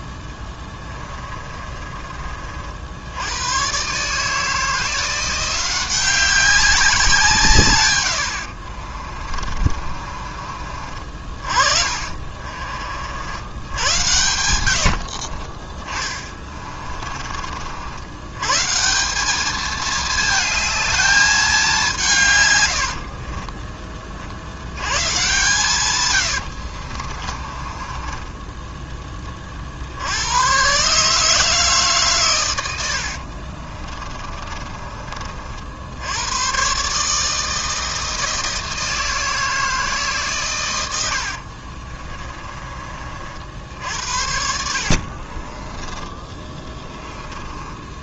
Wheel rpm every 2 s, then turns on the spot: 20, 70, 170, 180, 50, 40, 60, 80, 30, 170, 220, 90, 110, 60, 10, 130, 80, 30, 140, 160, 90, 40, 50, 20.
0-2 8-10 14-18 22-24 26-28 44-48